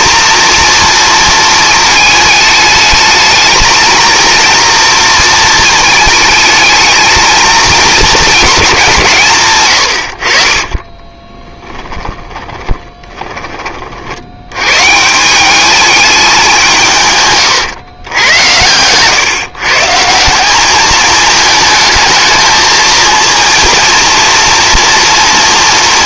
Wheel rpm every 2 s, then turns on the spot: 230, 220, 230, 220, 170, 30, 20, 160, 150, 120, 210, 230, 230.
10-14